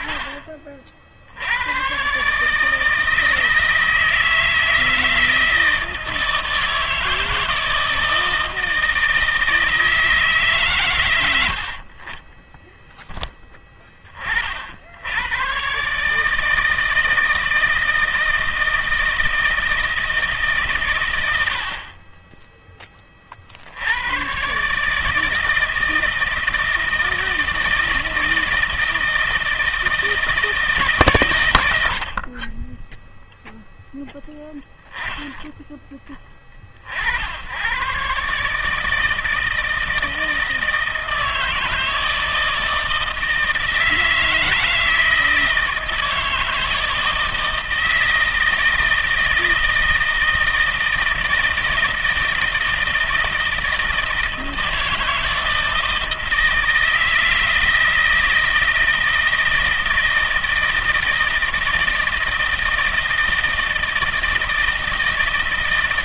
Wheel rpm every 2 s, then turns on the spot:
50, 160, 160, 160, 160, 120, 10, 70, 160, 160, 120, 20, 150, 160, 160, 150, 30, 10, 50, 160, 160, 160, 160, 160, 160, 160, 160, 170, 160, 160, 160, 160, 160.
32-34